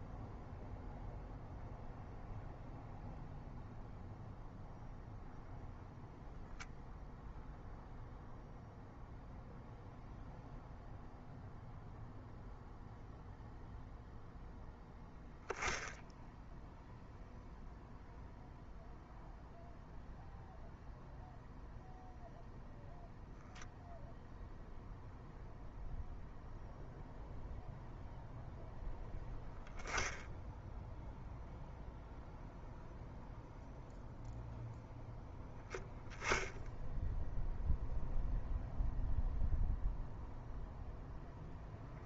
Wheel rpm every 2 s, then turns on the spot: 0, 0, 0, 0, 0, 0, 0, 0, 0, 0, 0, 0, 0, 0, 0, 0, 0, 0, 0, 0, 0.
none